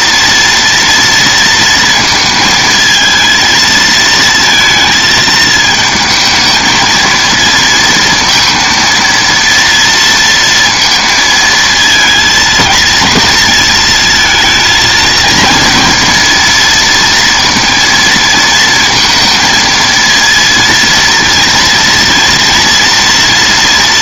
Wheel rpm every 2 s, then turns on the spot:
230, 230, 220, 220, 230, 230, 230, 220, 230, 230, 230, 230.
none